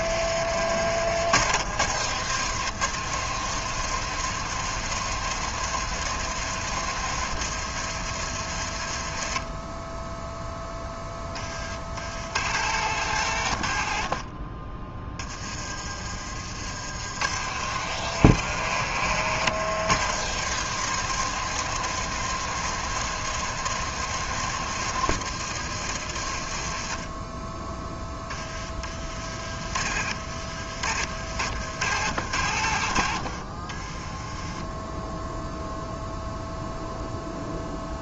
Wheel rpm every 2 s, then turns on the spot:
50, 110, 110, 110, 50, 20, 80, 40, 80, 90, 110, 110, 110, 40, 40, 60, 60, 10, 0.
14-16 28-30 32-34